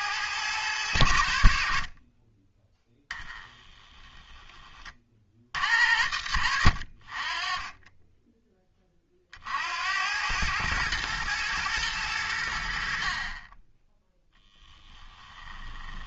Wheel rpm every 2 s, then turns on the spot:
100, 10, 30, 60, 20, 110, 60, 10.
14-16